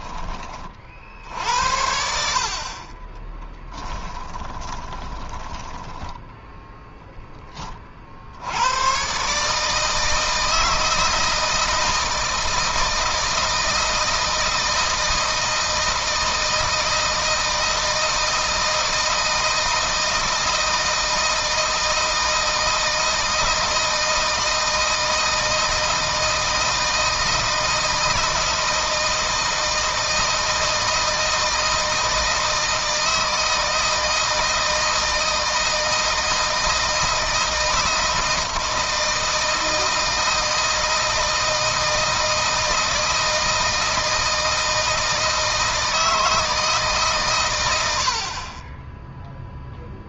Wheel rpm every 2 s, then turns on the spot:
50, 40, 20, 0, 100, 160, 160, 160, 160, 160, 160, 160, 160, 160, 160, 160, 160, 160, 160, 160, 160, 160, 160, 150, 20.
4-6